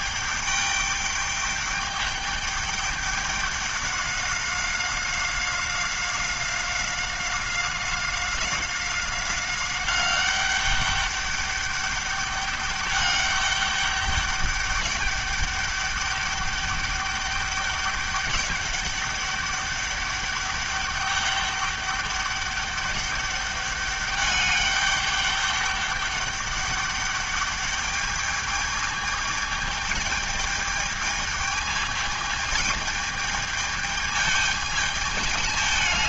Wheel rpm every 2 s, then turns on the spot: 210, 200, 190, 190, 190, 200, 200, 200, 200, 200, 200, 200, 200, 200, 210, 210, 220, 210.
none